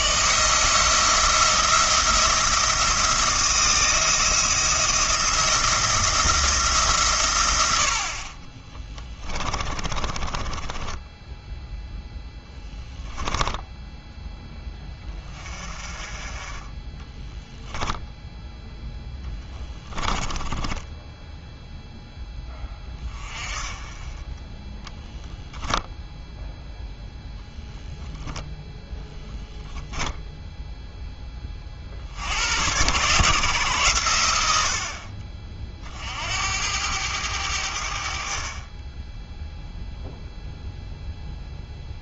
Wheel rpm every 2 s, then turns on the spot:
170, 170, 170, 140, 10, 10, 10, 20, 20, 10, 20, 20, 10, 10, 0, 0, 100, 70, 90, 20, 0.
8-14 20-22